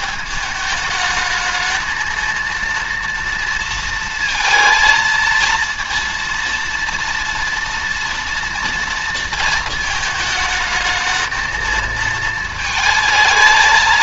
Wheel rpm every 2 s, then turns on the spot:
210, 230, 230, 230, 230, 220, 230.
none